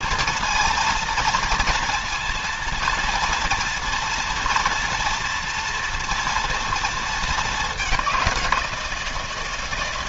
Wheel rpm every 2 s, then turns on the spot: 230, 230, 230, 230, 170.
none